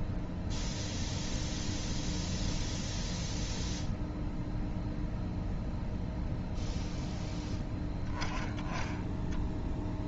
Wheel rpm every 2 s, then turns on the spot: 0, 0, 0, 0, 10.
none